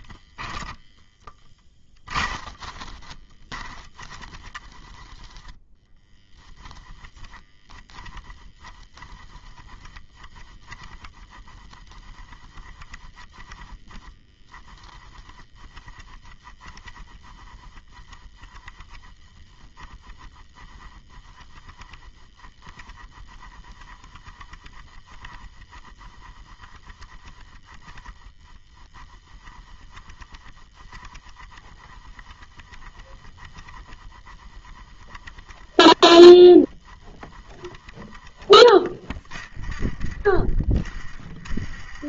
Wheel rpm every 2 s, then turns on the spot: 10, 10, 10, 20, 10, 10, 20, 20, 10, 10, 10, 10, 10, 10, 0, 10, 10, 10, 10, 20, 20.
0-2